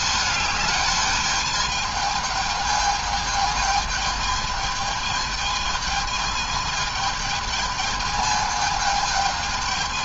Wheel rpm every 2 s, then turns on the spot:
210, 220, 220, 220, 220.
none